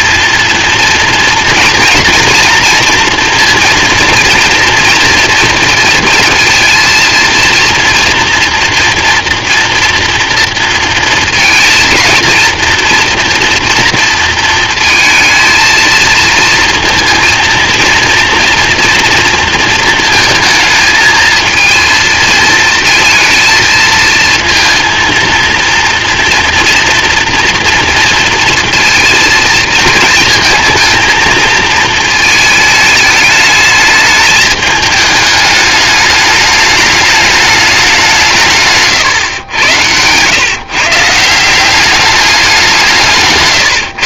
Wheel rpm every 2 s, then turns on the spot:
230, 230, 230, 230, 240, 230, 230, 230, 230, 230, 220, 230, 230, 230, 230, 220, 220, 210, 210, 140, 140, 180.
38-40